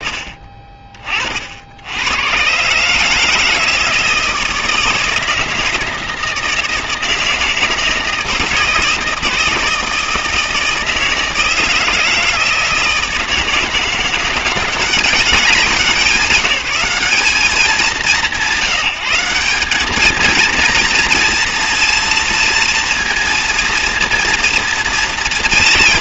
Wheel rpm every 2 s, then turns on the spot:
20, 120, 160, 160, 160, 160, 160, 180, 190, 160, 220, 230, 230.
none